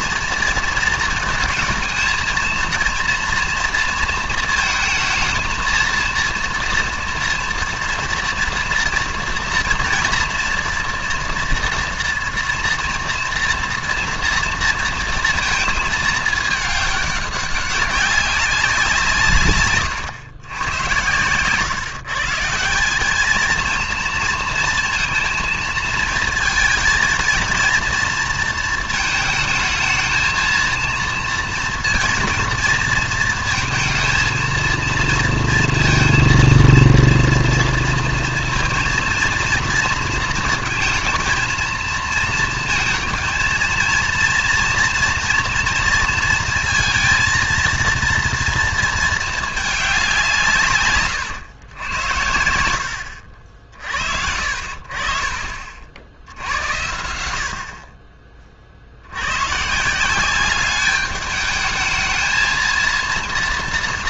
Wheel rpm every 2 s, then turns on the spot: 230, 230, 230, 240, 240, 240, 230, 230, 210, 190, 100, 170, 230, 220, 230, 230, 230, 230, 230, 230, 230, 230, 230, 230, 230, 150, 90, 50, 80, 40, 200, 230.
none